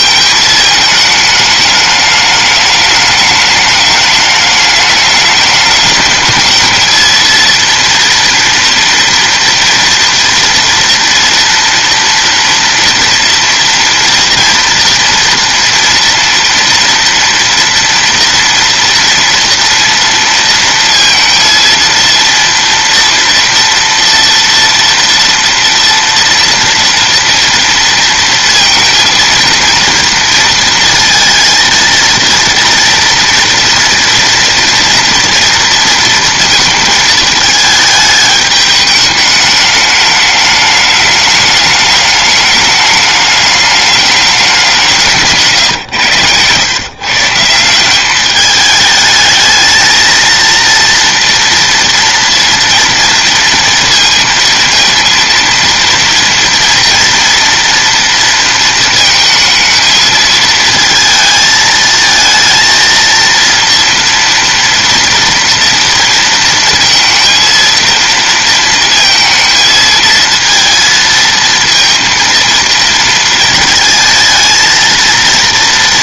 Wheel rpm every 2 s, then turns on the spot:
220, 210, 210, 220, 230, 240, 230, 230, 230, 230, 230, 230, 230, 230, 230, 230, 230, 230, 230, 210, 210, 210, 190, 120, 210, 230, 230, 230, 230, 230, 220, 230, 240, 230, 230, 220, 230, 230.
none